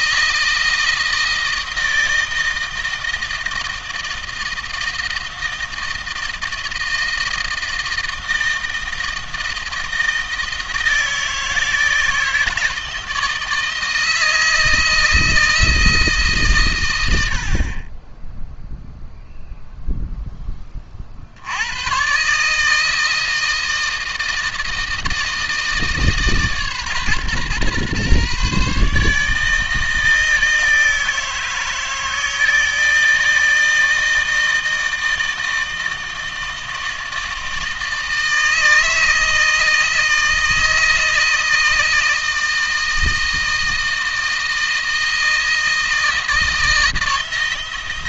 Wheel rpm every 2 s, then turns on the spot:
160, 160, 160, 160, 160, 160, 160, 160, 100, 0, 40, 160, 160, 140, 150, 160, 160, 160, 160, 160, 160, 160, 160, 160.
none